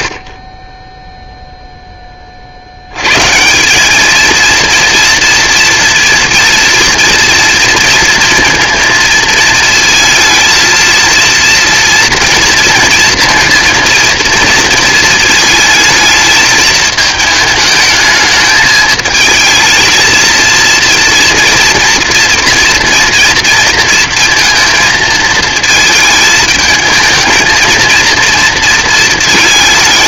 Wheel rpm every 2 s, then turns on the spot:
20, 70, 230, 230, 230, 230, 230, 230, 220, 210, 230, 230, 230, 220, 230.
none